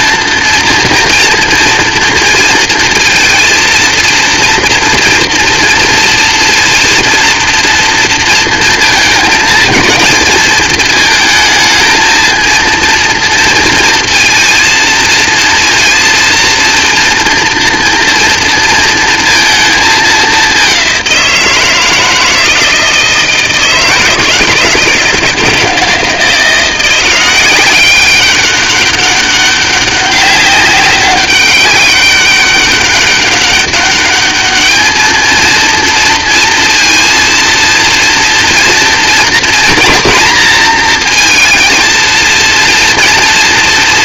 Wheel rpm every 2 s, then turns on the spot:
230, 230, 240, 230, 230, 220, 230, 230, 230, 230, 190, 160, 160, 180, 200, 200, 200, 220, 230, 230, 230, 230.
none